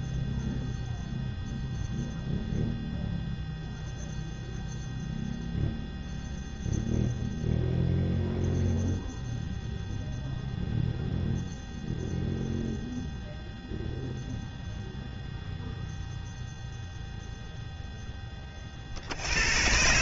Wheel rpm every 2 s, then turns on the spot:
0, 0, 0, 0, 0, 0, 0, 0, 0, 0.
none